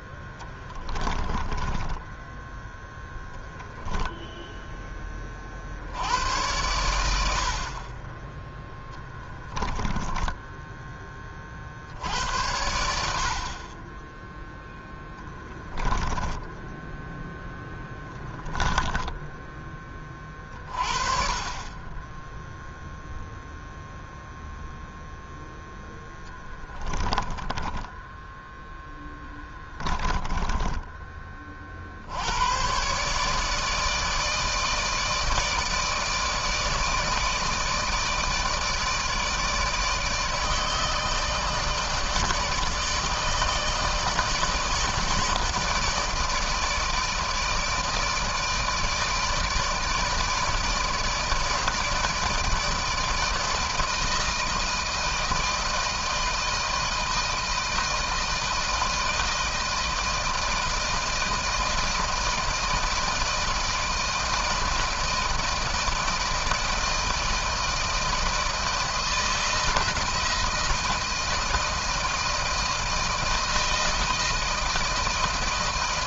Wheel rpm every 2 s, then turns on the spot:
20, 10, 10, 100, 20, 10, 80, 10, 10, 10, 30, 10, 0, 10, 0, 20, 100, 160, 160, 160, 160, 160, 160, 160, 160, 160, 160, 160, 160, 160, 160, 160, 160, 160, 160, 160, 160, 160.
0-4 16-20 30-32